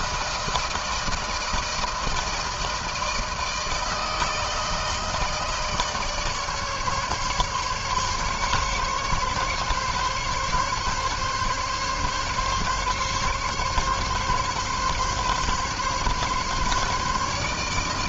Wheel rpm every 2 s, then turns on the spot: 160, 160, 160, 150, 140, 140, 140, 140, 150.
none